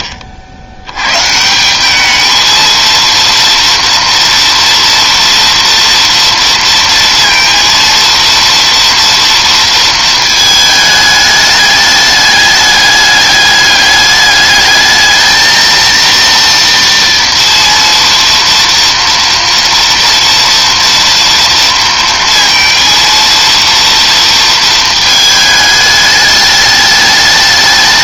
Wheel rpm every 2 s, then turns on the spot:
70, 220, 240, 230, 230, 220, 210, 210, 230, 230, 230, 230, 230, 210.
none